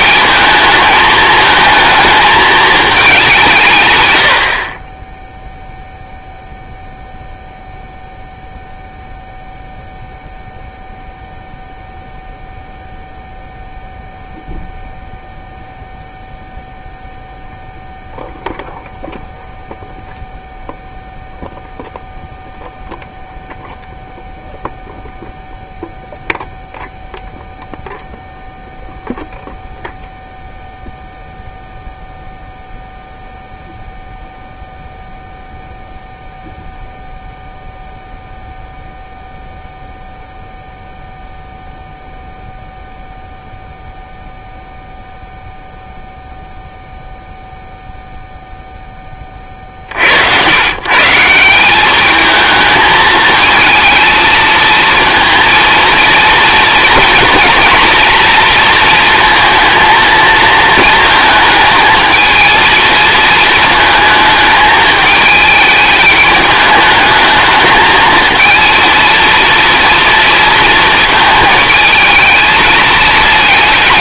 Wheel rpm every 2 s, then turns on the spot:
210, 220, 10, 0, 0, 0, 0, 0, 0, 0, 0, 0, 0, 0, 0, 0, 0, 0, 0, 0, 0, 0, 0, 0, 0, 140, 220, 220, 230, 230, 230, 230, 220, 210, 220, 230, 220.
none